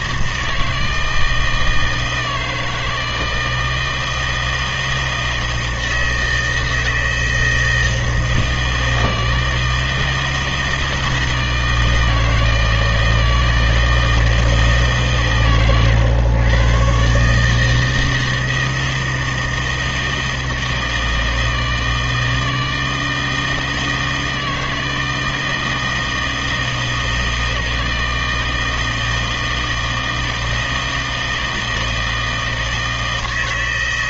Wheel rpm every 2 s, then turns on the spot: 160, 160, 160, 160, 160, 160, 160, 160, 120, 160, 160, 160, 160, 160, 160, 160, 160.
none